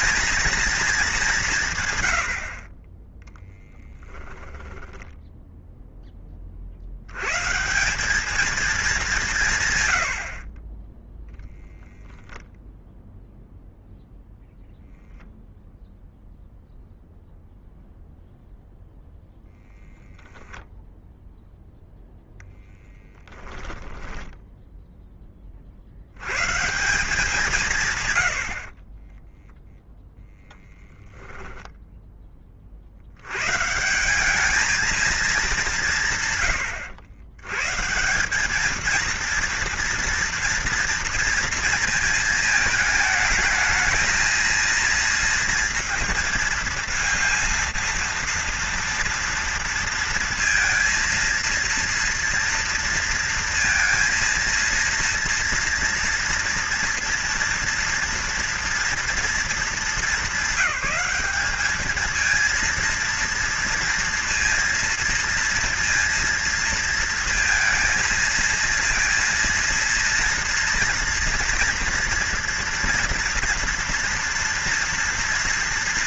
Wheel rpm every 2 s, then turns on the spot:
220, 30, 10, 70, 210, 20, 0, 0, 0, 0, 0, 10, 10, 160, 30, 0, 60, 220, 100, 220, 230, 220, 230, 230, 230, 230, 230, 230, 230, 230, 200, 230, 230, 230, 230, 240, 230, 230.
4-6 10-12